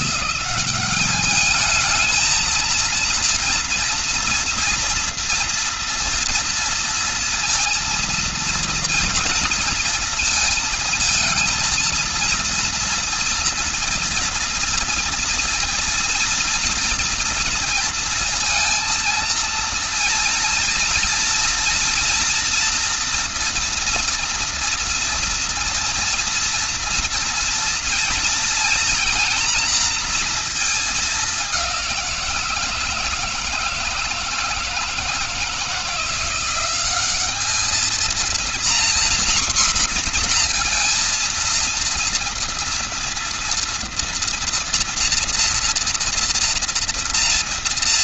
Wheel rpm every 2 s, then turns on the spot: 200, 230, 230, 230, 230, 230, 240, 230, 240, 230, 230, 240, 230, 230, 230, 220, 160, 160, 190, 240, 230, 230, 240, 230.
none